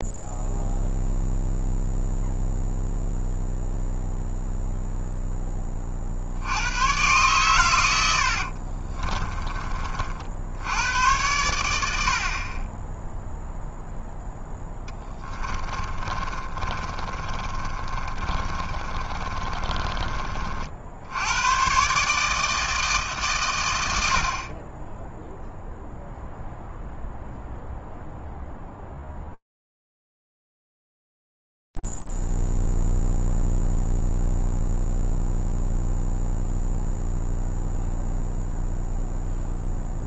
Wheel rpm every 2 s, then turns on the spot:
0, 0, 0, 120, 50, 90, 30, 10, 40, 30, 50, 160, 20, 0, 0, 0, 0, 0, 0, 0.
8-10 14-20